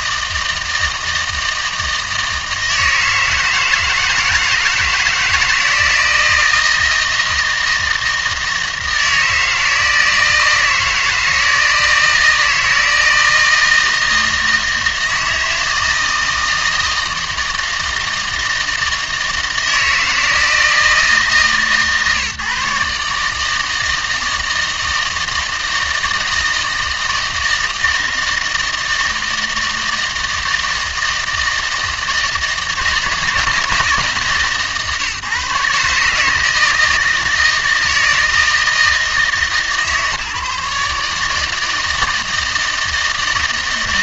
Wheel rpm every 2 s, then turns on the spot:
160, 160, 160, 160, 160, 160, 160, 160, 160, 160, 160, 150, 160, 160, 160, 160, 160, 150, 160, 160, 150, 160.
none